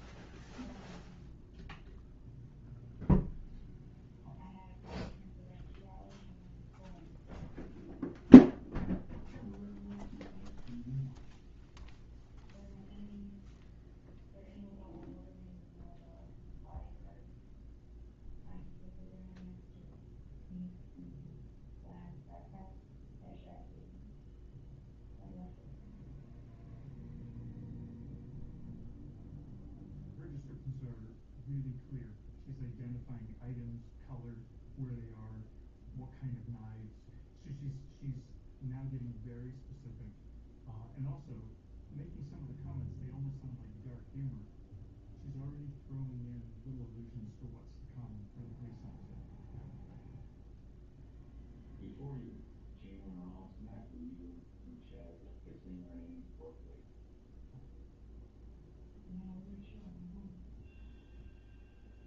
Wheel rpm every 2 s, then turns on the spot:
0, 0, 0, 0, 0, 0, 0, 0, 0, 0, 0, 0, 0, 0, 0, 0, 0, 0, 0, 0, 0, 0, 0, 0, 0, 0, 0, 0, 0, 0, 0.
none